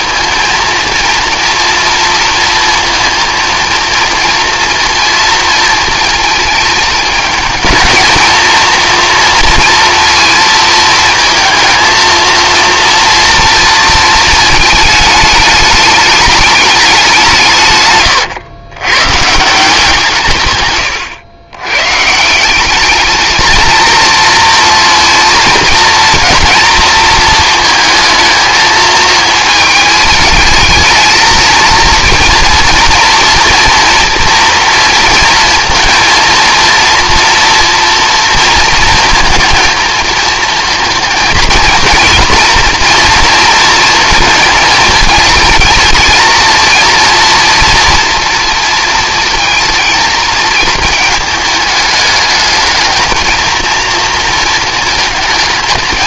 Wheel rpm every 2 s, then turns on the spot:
230, 230, 230, 220, 230, 230, 230, 220, 210, 110, 130, 200, 230, 230, 220, 220, 230, 230, 230, 230, 230, 240, 220, 230, 230, 220, 220, 220.
none